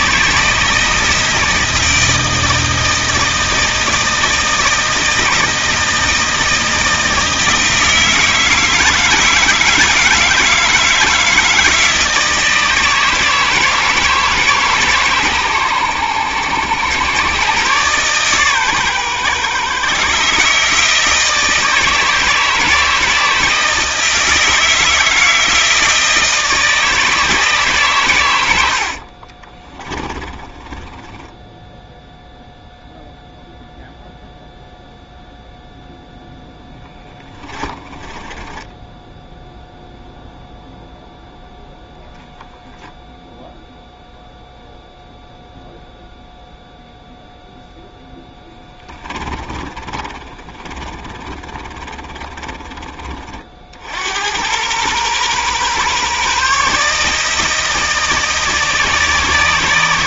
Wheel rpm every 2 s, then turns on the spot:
160, 160, 170, 160, 160, 160, 160, 140, 110, 130, 160, 160, 160, 160, 70, 20, 0, 0, 10, 10, 0, 10, 0, 0, 20, 30, 30, 110, 150, 160.
28-32 36-40 48-52